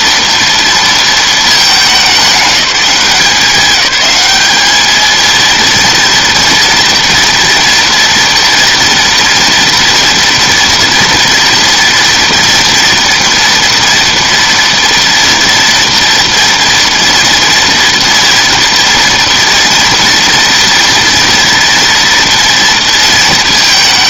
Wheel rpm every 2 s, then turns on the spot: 230, 190, 220, 230, 230, 230, 230, 230, 240, 230, 230, 220.
none